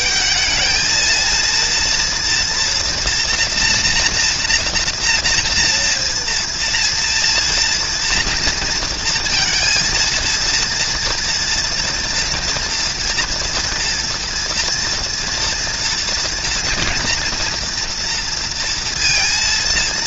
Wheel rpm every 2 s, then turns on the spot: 210, 240, 240, 230, 230, 230, 230, 230, 240, 230.
none